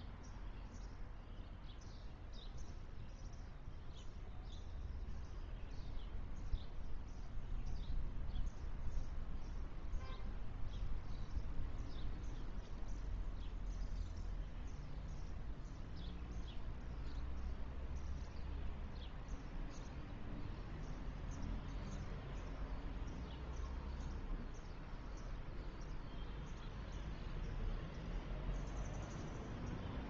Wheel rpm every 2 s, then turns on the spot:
0, 0, 0, 0, 0, 0, 0, 0, 0, 0, 0, 0, 0, 0, 0.
none